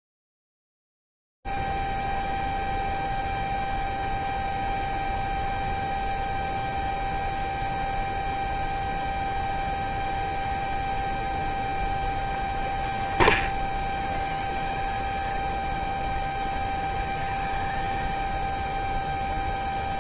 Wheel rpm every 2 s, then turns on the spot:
0, 0, 0, 0, 0, 0, 0, 0, 0, 0.
none